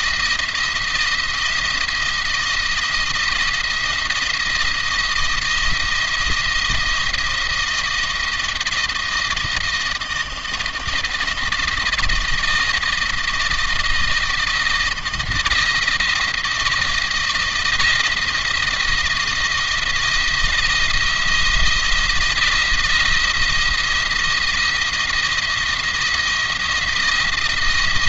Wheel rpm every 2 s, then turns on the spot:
170, 170, 170, 170, 170, 160, 170, 160, 170, 170, 170, 170, 170, 170.
none